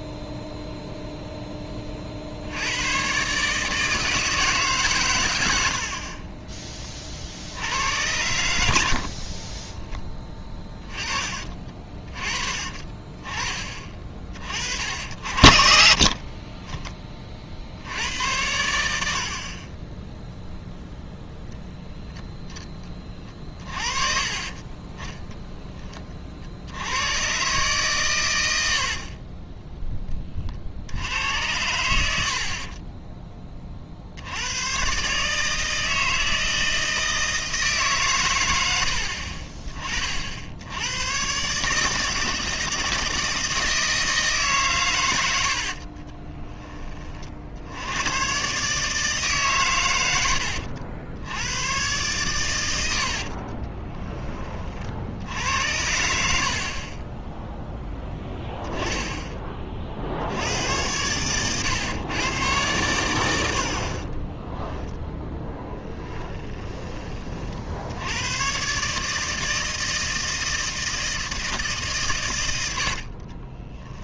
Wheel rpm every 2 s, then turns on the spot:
0, 100, 130, 20, 70, 20, 40, 60, 20, 80, 10, 20, 30, 80, 60, 70, 20, 120, 160, 80, 90, 160, 120, 20, 150, 80, 90, 50, 30, 0, 90, 100, 0, 20, 150, 160, 80.
32-34 52-54 56-58 72-74